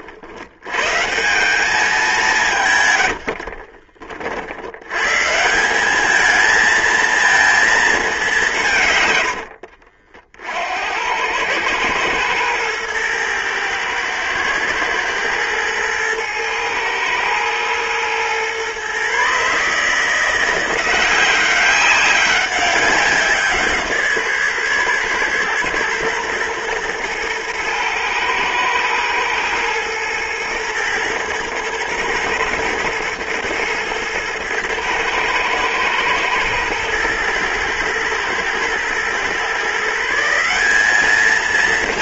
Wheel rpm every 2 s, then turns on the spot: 100, 150, 70, 220, 180, 60, 110, 110, 110, 120, 170, 190, 140, 120, 120, 120, 110, 110, 110, 120, 190.
none